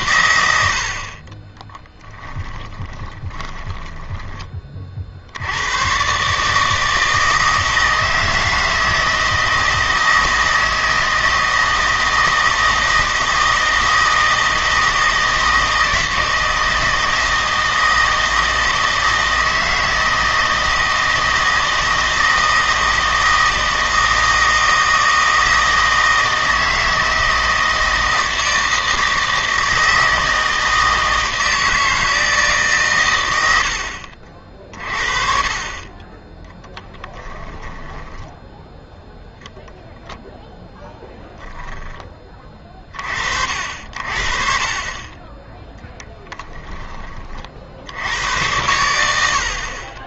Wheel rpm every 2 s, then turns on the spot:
90, 20, 40, 160, 160, 160, 160, 160, 160, 160, 160, 160, 160, 160, 160, 160, 150, 50, 10, 0, 10, 40, 40, 10, 90.
2-4 36-38